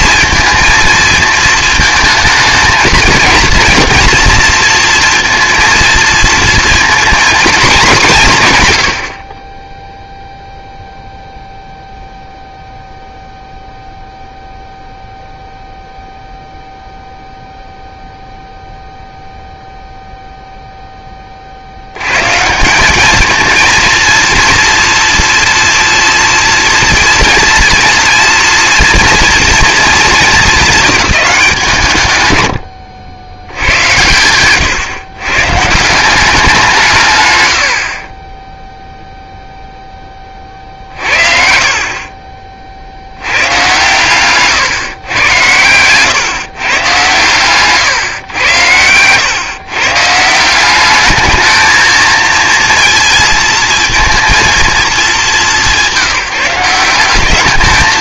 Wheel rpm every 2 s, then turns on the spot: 230, 220, 230, 240, 110, 0, 0, 0, 0, 0, 0, 170, 230, 230, 230, 220, 90, 120, 160, 0, 50, 40, 130, 130, 100, 190, 230, 230, 170.
none